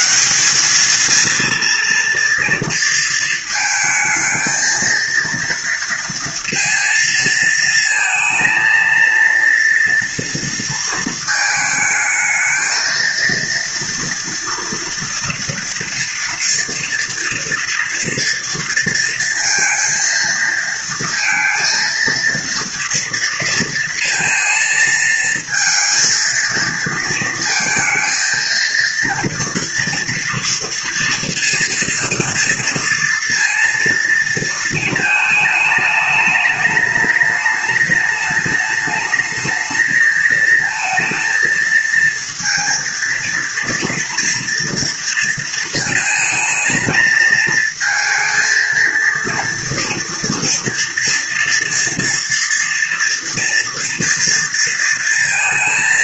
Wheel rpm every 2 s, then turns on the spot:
70, 230, 220, 230, 220, 230, 220, 230, 230, 230, 230, 230, 230, 230, 220, 230, 230, 230, 220, 210, 220, 230, 230, 230, 230, 230, 230, 230.
none